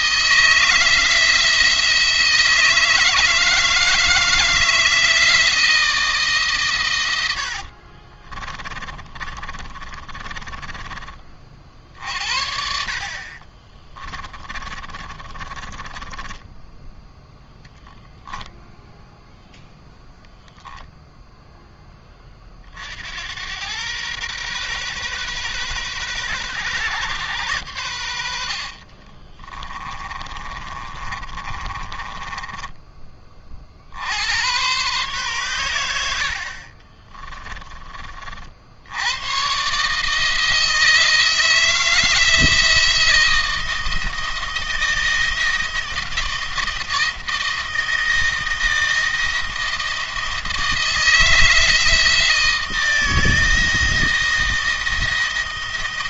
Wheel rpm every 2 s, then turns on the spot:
170, 160, 160, 110, 30, 30, 60, 30, 10, 10, 0, 60, 130, 130, 50, 30, 20, 120, 40, 80, 160, 160, 170, 160, 160, 160, 160, 170.
6-10 14-16 28-32 36-38